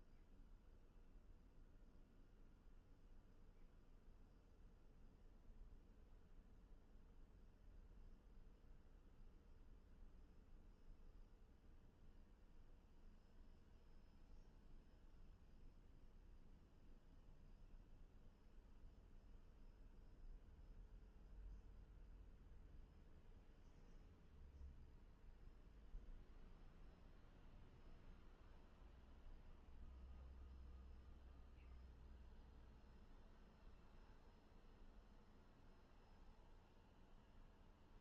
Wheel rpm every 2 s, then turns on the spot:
0, 0, 0, 0, 0, 0, 0, 0, 0, 0, 0, 0, 0, 0, 0, 0, 0, 0, 0.
none